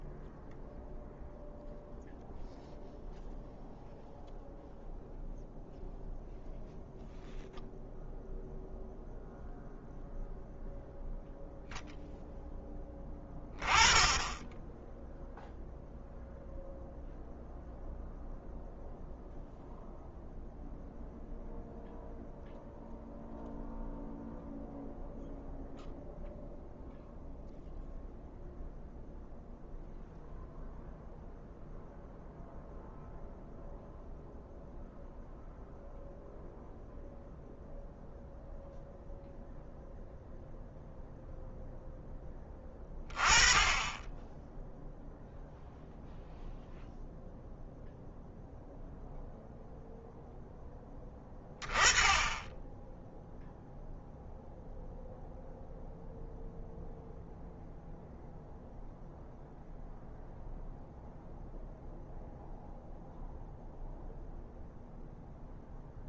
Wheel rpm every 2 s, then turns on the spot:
0, 0, 0, 0, 0, 0, 10, 0, 0, 0, 0, 0, 0, 0, 0, 0, 0, 0, 0, 0, 0, 20, 0, 0, 0, 10, 0, 0, 0, 0, 0, 0, 0.
none